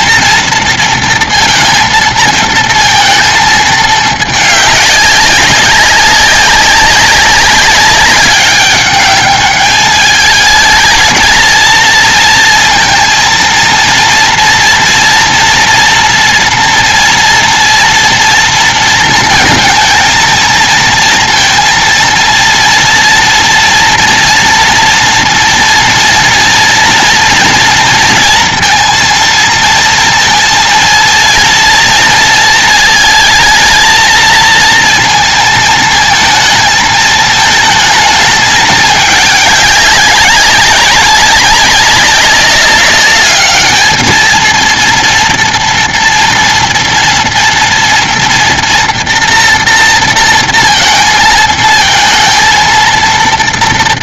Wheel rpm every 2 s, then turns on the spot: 230, 230, 210, 190, 200, 220, 230, 230, 230, 240, 220, 230, 230, 230, 230, 230, 230, 220, 220, 220, 190, 200, 220, 230, 230, 230, 230.
none